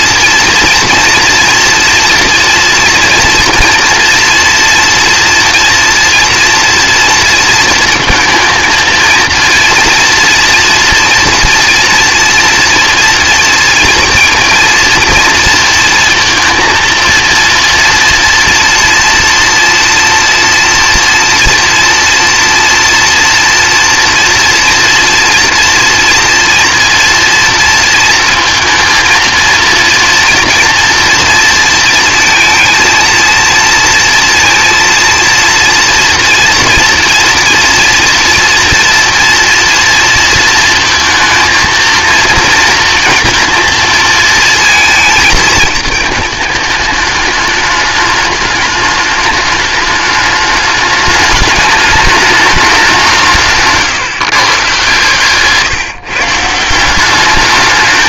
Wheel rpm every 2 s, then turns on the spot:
230, 230, 230, 230, 230, 240, 230, 230, 230, 230, 230, 230, 230, 230, 230, 240, 230, 230, 240, 230, 230, 230, 220, 210, 210, 210, 200, 140, 170.
none